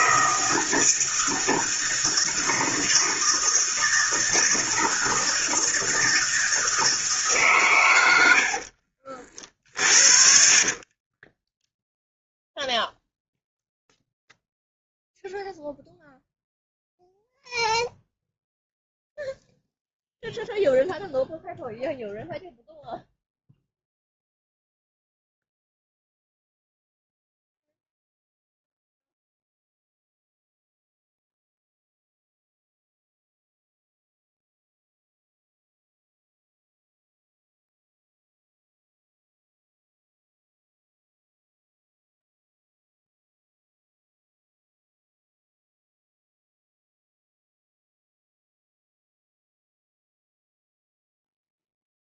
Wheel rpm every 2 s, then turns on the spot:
160, 160, 170, 160, 50, 40, 0, 0, 0, 0, 0, 0, 0, 0, 0, 0, 0, 0, 0, 0, 0, 0, 0, 0, 0, 0.
8-12